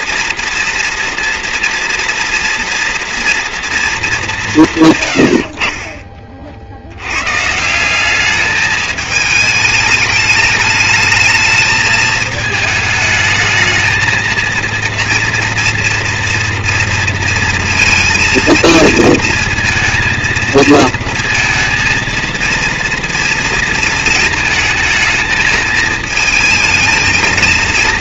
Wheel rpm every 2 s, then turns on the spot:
240, 230, 140, 100, 210, 210, 220, 230, 230, 230, 230, 230, 220, 230.
none